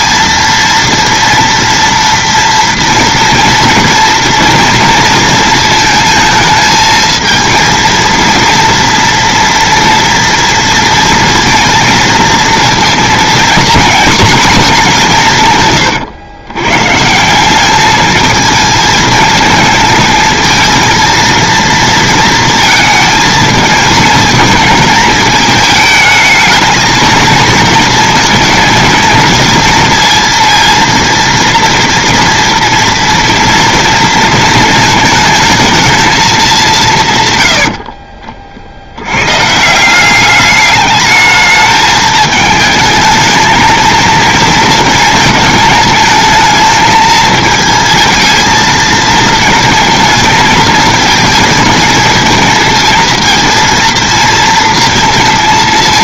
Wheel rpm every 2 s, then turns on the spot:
230, 230, 230, 230, 230, 230, 230, 120, 210, 230, 230, 220, 220, 220, 230, 230, 220, 210, 40, 190, 210, 230, 220, 220, 220, 220, 230, 230.
none